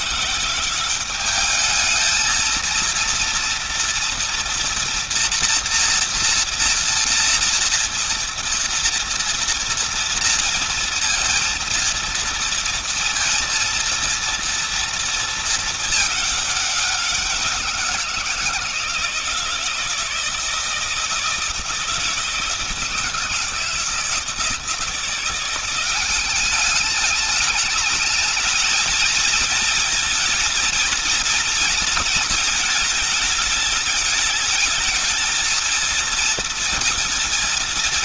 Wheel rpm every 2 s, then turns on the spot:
180, 230, 230, 230, 230, 230, 230, 230, 200, 170, 160, 160, 160, 200, 220, 230, 220, 220, 230.
none